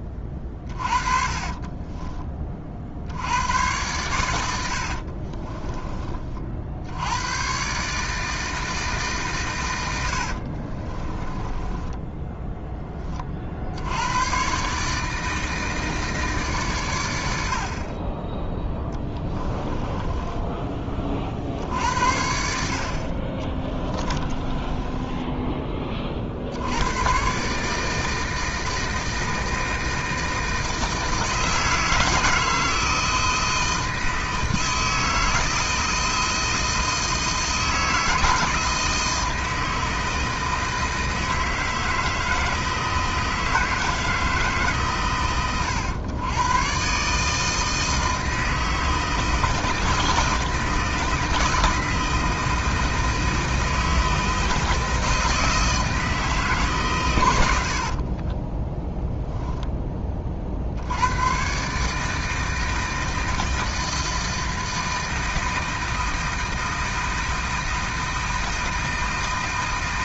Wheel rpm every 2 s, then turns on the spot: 30, 50, 70, 70, 150, 40, 10, 140, 120, 10, 20, 60, 20, 90, 160, 160, 160, 160, 160, 160, 160, 160, 140, 130, 160, 160, 160, 160, 140, 10, 70, 160, 160, 160, 160.
0-2 4-6 10-12 18-20 24-26